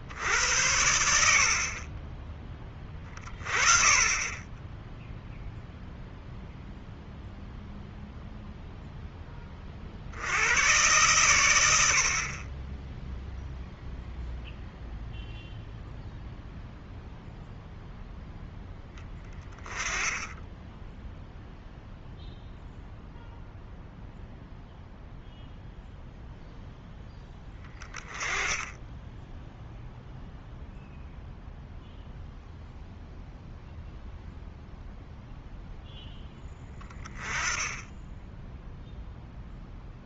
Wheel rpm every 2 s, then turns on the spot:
90, 10, 10, 0, 0, 100, 10, 0, 0, 10, 0, 0, 0, 0, 10, 0, 0, 0, 10, 0.
none